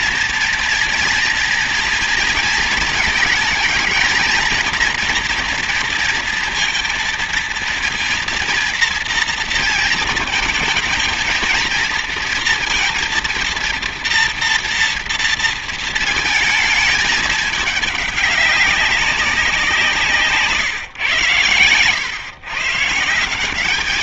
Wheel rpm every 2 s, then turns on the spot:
230, 230, 220, 230, 230, 220, 240, 230, 220, 200, 150, 140.
none